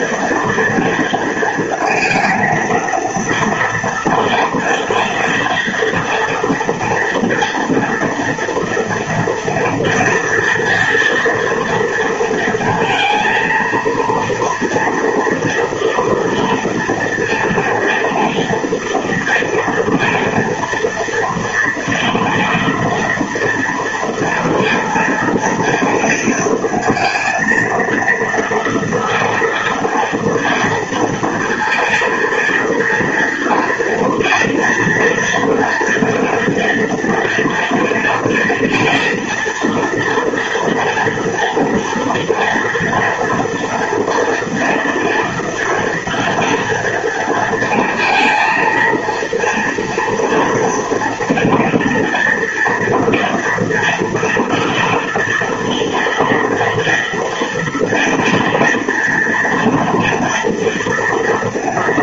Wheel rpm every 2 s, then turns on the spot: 230, 230, 230, 230, 230, 230, 230, 230, 230, 230, 230, 230, 230, 230, 230, 230, 230, 230, 230, 240, 240, 230, 240, 230, 230, 240, 240, 230, 230, 230, 230.
none